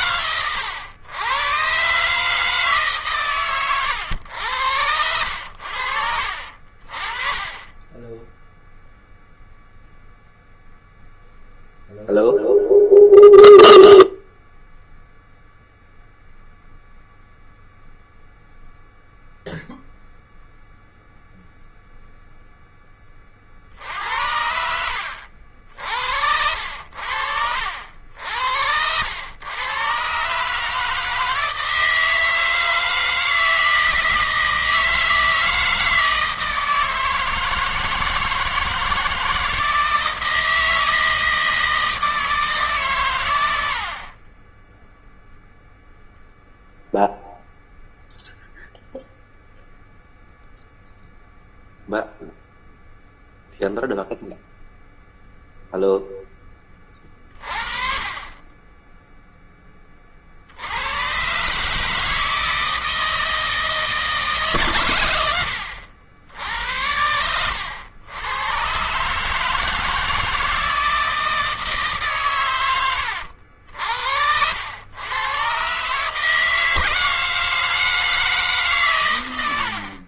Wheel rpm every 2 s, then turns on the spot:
120, 140, 80, 40, 0, 0, 0, 0, 0, 0, 0, 20, 60, 70, 90, 160, 160, 160, 160, 160, 160, 110, 0, 0, 0, 0, 0, 0, 30, 10, 100, 160, 100, 90, 130, 160, 90, 110, 160, 120.
78-80